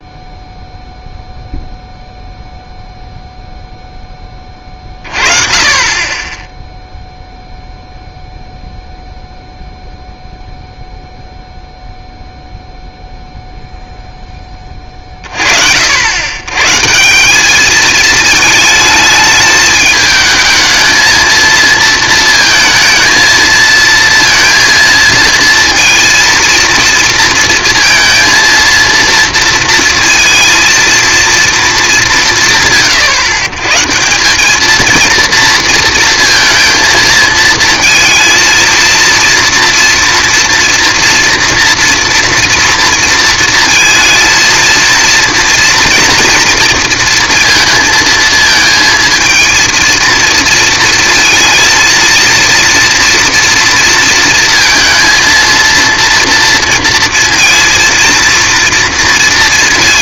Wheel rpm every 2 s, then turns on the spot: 0, 0, 30, 10, 0, 0, 0, 20, 120, 220, 220, 230, 230, 230, 230, 230, 150, 200, 230, 230, 230, 230, 230, 230, 230, 230, 230, 230, 230, 230.
none